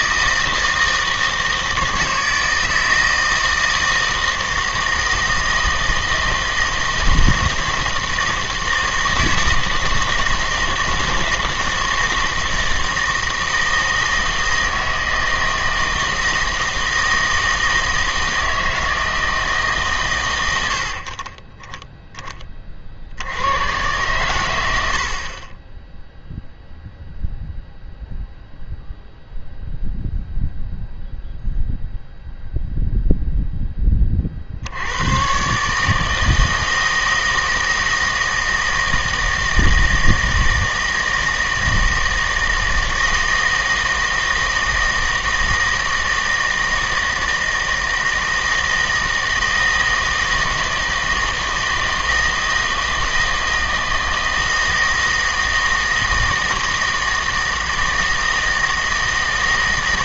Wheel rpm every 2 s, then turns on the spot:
160, 160, 160, 160, 160, 160, 160, 160, 160, 160, 80, 30, 100, 0, 0, 0, 0, 80, 160, 160, 160, 160, 160, 160, 160, 160, 160, 160, 160, 160.
none